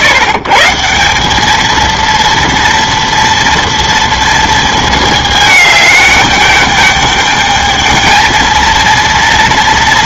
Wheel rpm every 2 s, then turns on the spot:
130, 230, 230, 210, 230.
none